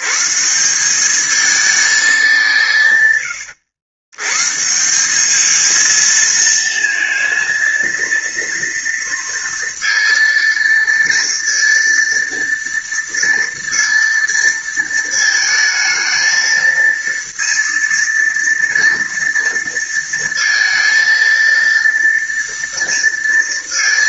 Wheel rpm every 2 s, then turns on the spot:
190, 160, 160, 230, 230, 230, 230, 230, 230, 230, 230, 230.
none